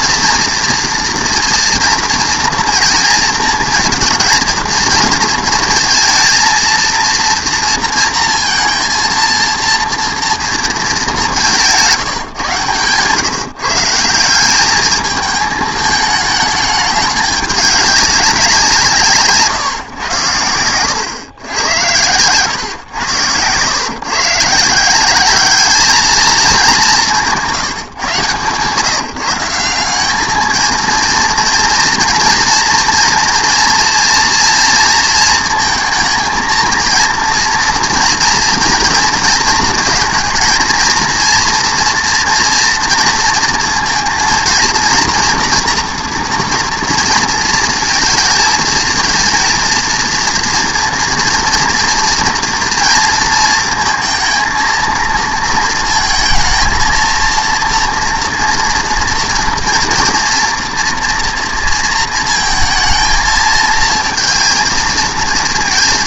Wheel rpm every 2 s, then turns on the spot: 230, 230, 230, 230, 230, 220, 140, 200, 210, 180, 100, 120, 160, 210, 150, 220, 230, 230, 230, 230, 230, 230, 230, 230, 220, 230, 230, 230, 230, 230, 230, 220, 230.
none